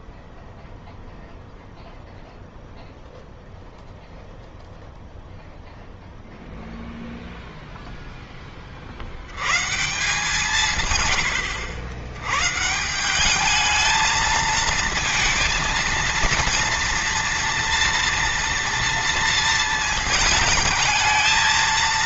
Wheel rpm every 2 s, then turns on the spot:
0, 0, 0, 0, 50, 130, 160, 220, 230, 230, 210.
none